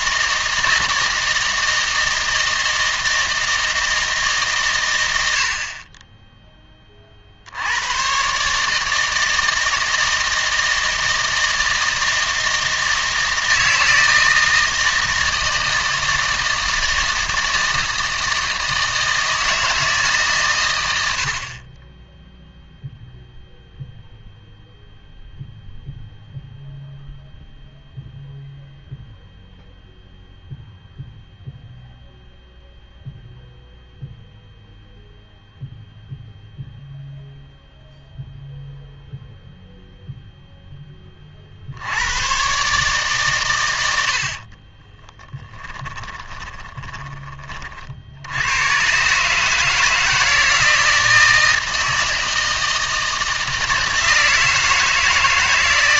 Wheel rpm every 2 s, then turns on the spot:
160, 160, 120, 20, 150, 160, 160, 160, 160, 160, 90, 0, 0, 0, 0, 0, 0, 0, 0, 0, 10, 140, 30, 20, 120, 160, 160, 160.
44-48